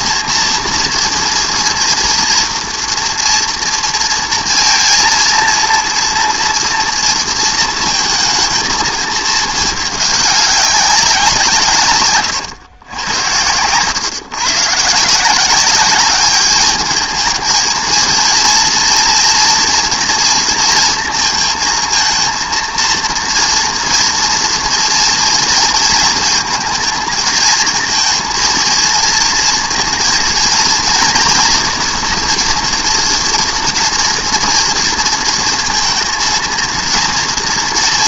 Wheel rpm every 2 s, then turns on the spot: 230, 230, 230, 230, 220, 190, 110, 140, 210, 230, 230, 230, 230, 220, 230, 230, 240, 230, 230.
none